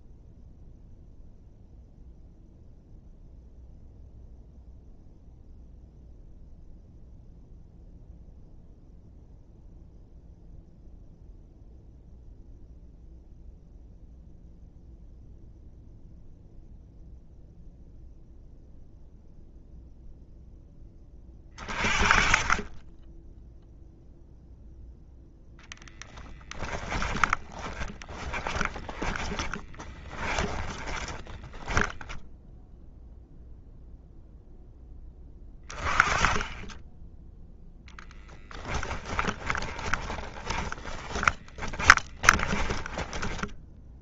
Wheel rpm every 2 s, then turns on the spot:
0, 0, 0, 0, 0, 0, 0, 0, 0, 0, 0, 20, 0, 20, 20, 30, 0, 0, 20, 10, 20, 20.
26-32 38-44